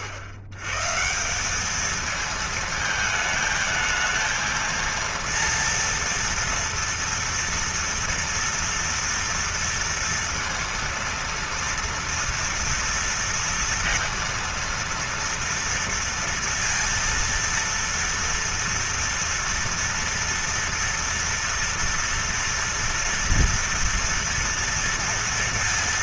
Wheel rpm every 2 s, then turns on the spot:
110, 220, 230, 230, 230, 230, 230, 230, 230, 230, 230, 230, 230.
none